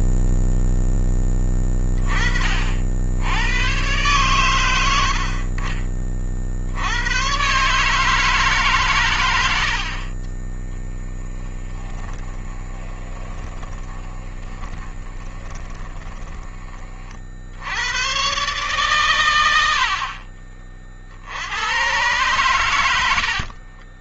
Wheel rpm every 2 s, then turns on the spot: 10, 60, 80, 80, 130, 20, 20, 20, 40, 130, 60, 90.
10-16